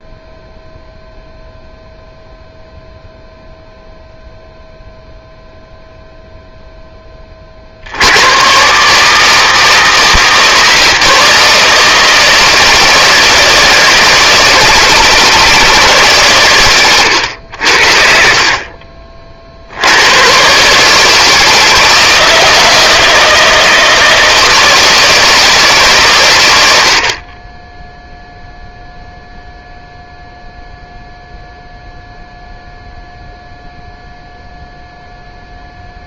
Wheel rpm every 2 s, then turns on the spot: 0, 0, 0, 10, 140, 160, 160, 160, 110, 40, 140, 160, 160, 70, 0, 0, 0, 0.
16-18